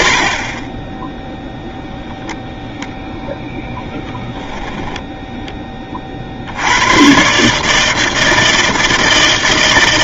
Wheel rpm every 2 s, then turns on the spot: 40, 0, 10, 80, 160.
4-6